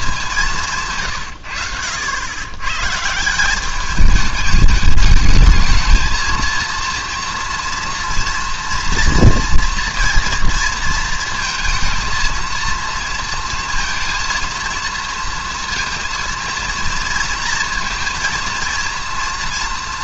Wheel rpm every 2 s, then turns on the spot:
170, 110, 210, 230, 230, 230, 230, 230, 230, 230.
none